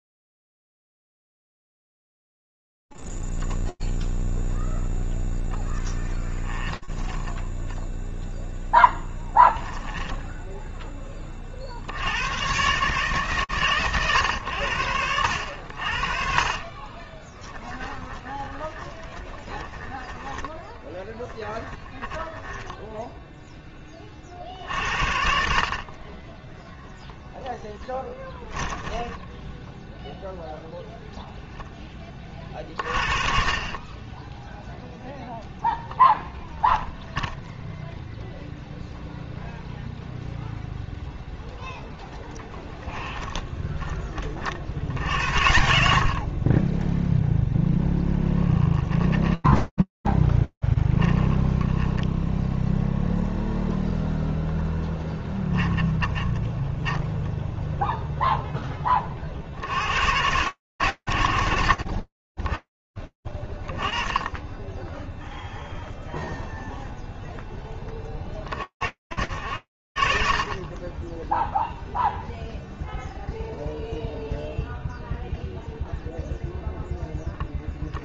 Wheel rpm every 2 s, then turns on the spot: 0, 0, 0, 20, 0, 10, 130, 100, 30, 20, 10, 30, 30, 10, 0, 20, 20, 0, 0, 0, 10, 30, 60, 0, 10, 0, 0, 30, 0, 100, 40, 20, 0, 40, 70, 0, 0, 0, 10.
6-8 16-22 26-28 48-50 54-56